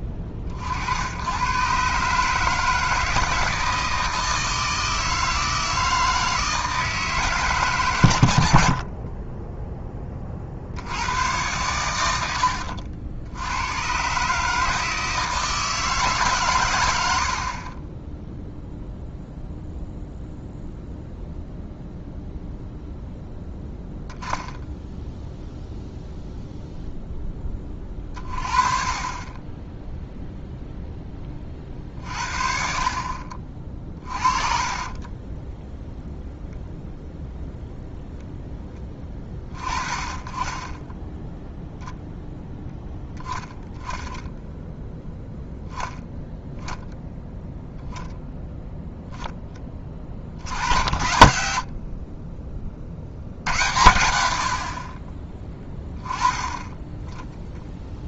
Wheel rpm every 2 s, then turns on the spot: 40, 150, 160, 160, 60, 60, 80, 150, 110, 0, 0, 0, 0, 0, 30, 0, 40, 30, 0, 10, 20, 0, 10, 10, 0, 60, 40, 50, 10.
12-14 34-36